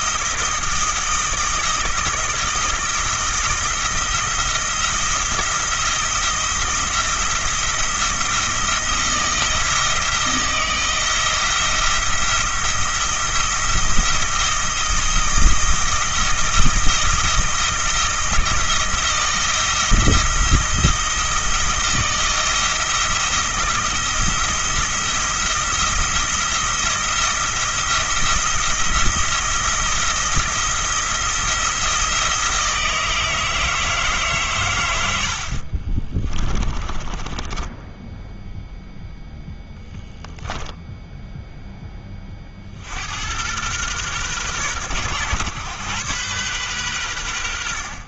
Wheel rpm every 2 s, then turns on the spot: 160, 160, 170, 170, 170, 160, 170, 170, 160, 170, 160, 170, 170, 170, 170, 170, 160, 110, 20, 0, 0, 70, 120, 110.
36-38